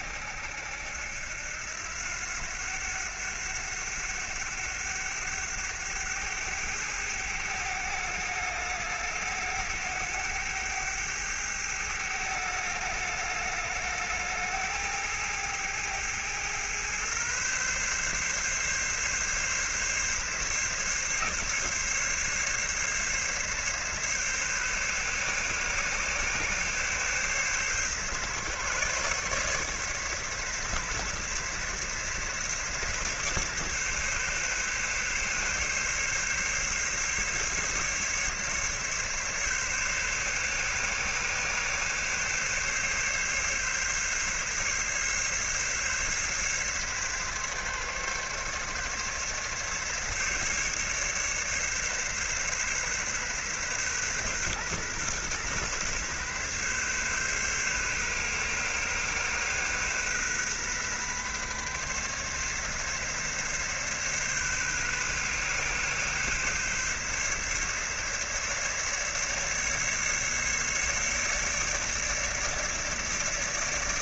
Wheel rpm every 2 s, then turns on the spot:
80, 90, 100, 100, 100, 100, 100, 110, 120, 140, 140, 140, 140, 140, 140, 140, 140, 140, 140, 140, 140, 140, 140, 140, 140, 140, 130, 130, 140, 130, 130, 140, 130, 140, 140, 150, 150.
none